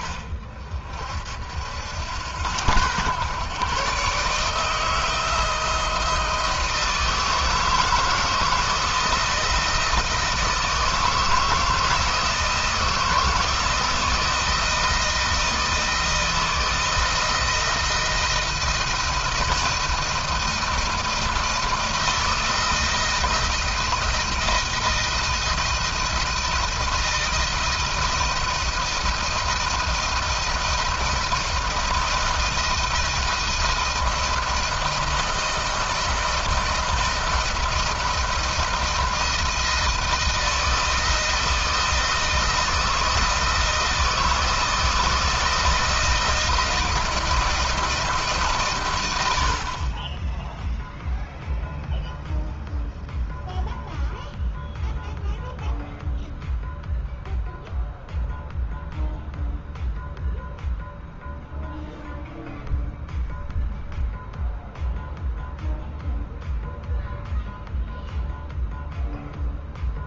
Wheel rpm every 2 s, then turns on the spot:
50, 100, 150, 160, 160, 160, 170, 160, 160, 160, 170, 160, 160, 170, 170, 170, 160, 160, 160, 160, 160, 170, 170, 170, 130, 0, 0, 0, 0, 0, 0, 0, 0, 0, 0.
none